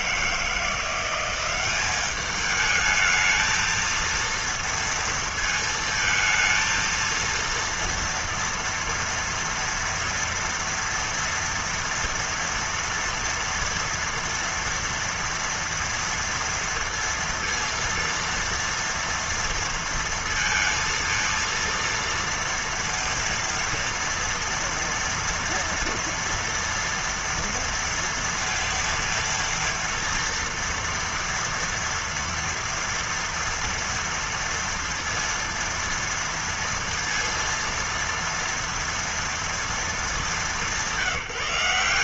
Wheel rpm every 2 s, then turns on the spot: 160, 210, 230, 230, 230, 230, 230, 230, 230, 230, 230, 230, 230, 230, 230, 230, 240, 230, 230, 230, 210.
none